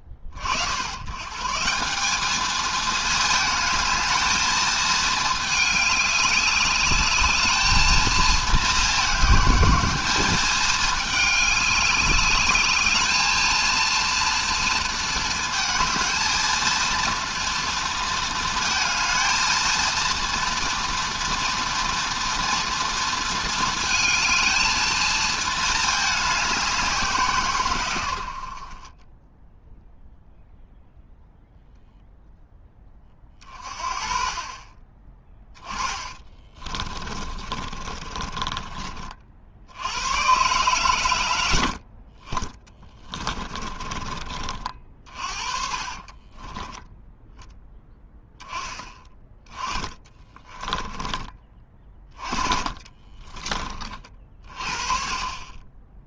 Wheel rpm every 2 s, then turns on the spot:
50, 220, 220, 200, 220, 200, 200, 230, 230, 230, 230, 240, 220, 200, 50, 0, 10, 30, 30, 30, 110, 20, 40, 20, 10, 20, 30, 40.
36-40 42-44 46-48 50-54